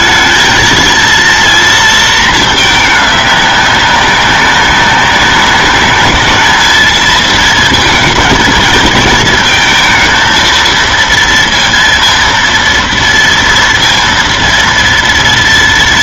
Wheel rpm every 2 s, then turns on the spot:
220, 220, 200, 220, 230, 230, 230, 230.
none